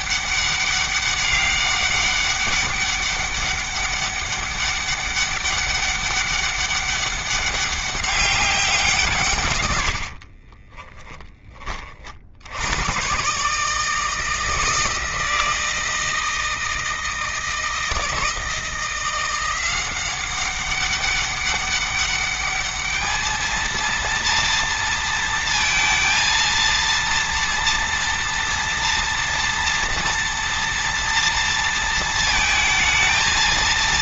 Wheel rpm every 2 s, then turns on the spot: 200, 200, 200, 200, 170, 20, 110, 160, 160, 170, 190, 210, 230, 230, 230, 230, 220.
10-12